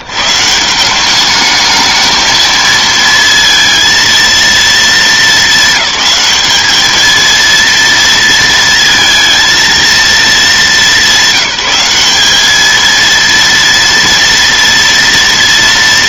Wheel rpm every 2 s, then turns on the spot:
120, 220, 230, 210, 230, 200, 220, 230.
none